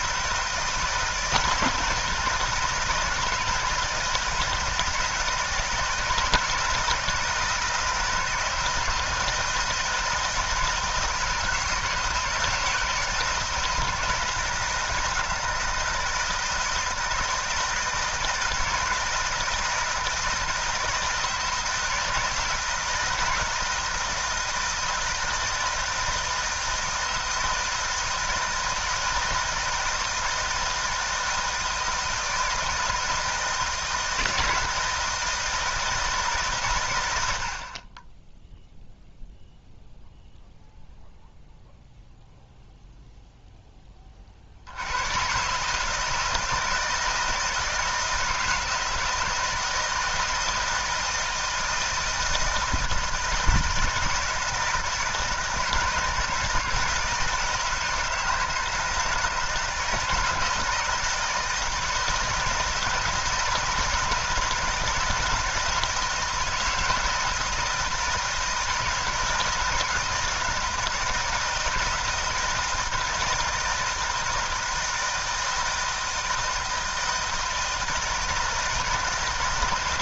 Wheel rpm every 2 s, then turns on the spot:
160, 160, 160, 160, 160, 160, 160, 170, 160, 160, 160, 160, 160, 160, 160, 160, 160, 160, 100, 0, 0, 0, 100, 160, 160, 160, 160, 160, 160, 160, 160, 160, 160, 160, 160, 160, 160, 160, 160, 160.
none